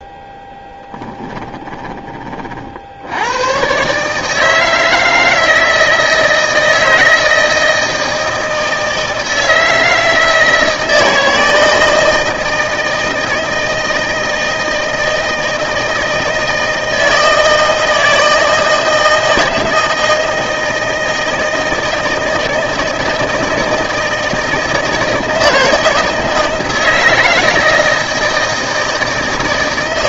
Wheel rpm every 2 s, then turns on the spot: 10, 60, 160, 160, 160, 160, 160, 160, 160, 160, 160, 160, 160, 160, 160.
none